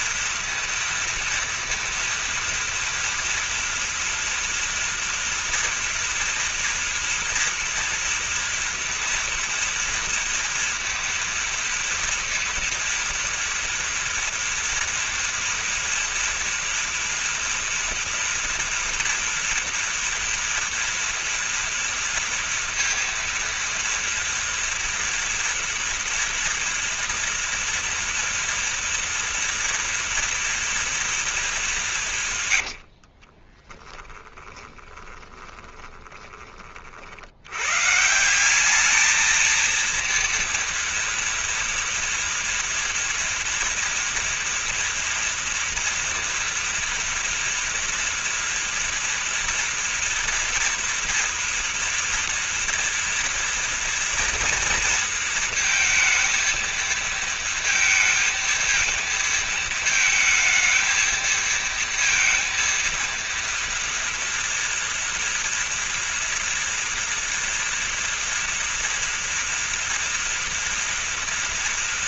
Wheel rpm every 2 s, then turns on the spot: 230, 230, 240, 240, 230, 230, 230, 240, 230, 230, 230, 230, 230, 230, 230, 230, 90, 20, 40, 200, 230, 230, 230, 230, 230, 230, 230, 230, 230, 220, 220, 230, 230, 230, 230, 230.
32-36